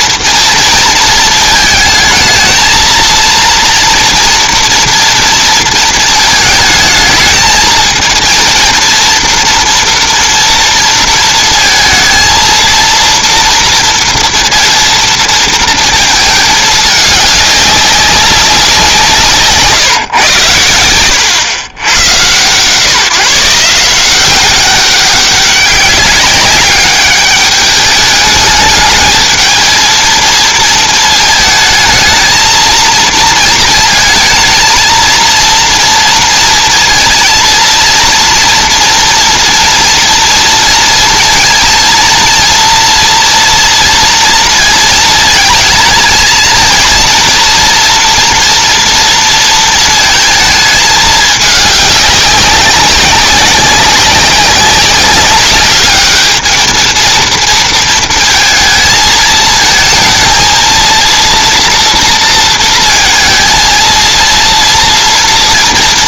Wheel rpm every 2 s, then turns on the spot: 230, 230, 230, 220, 230, 230, 230, 230, 210, 190, 90, 130, 190, 210, 210, 220, 230, 220, 230, 230, 230, 230, 230, 230, 230, 220, 190, 190, 220, 220, 230, 230, 230.
none